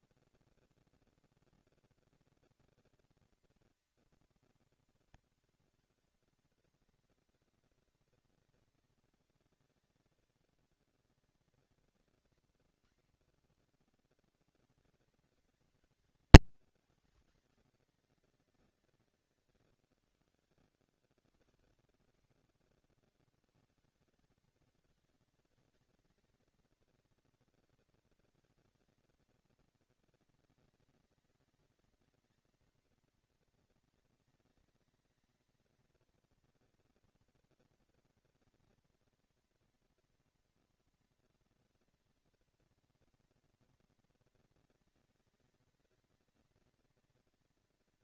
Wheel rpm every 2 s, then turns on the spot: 230, 230, 220, 200, 200, 200, 130, 170, 150, 110, 100, 150, 220, 230, 220, 210, 230, 220, 230, 230, 230, 230, 230, 230.
none